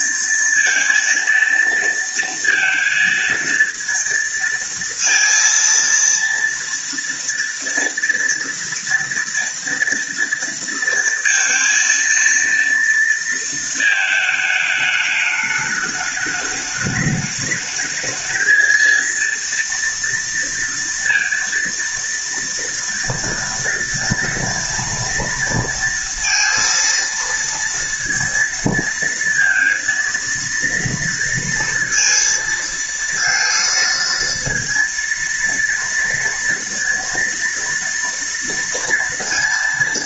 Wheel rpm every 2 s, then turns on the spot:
230, 230, 230, 230, 230, 230, 230, 210, 210, 230, 230, 230, 230, 230, 230, 230, 230, 230, 230, 230.
none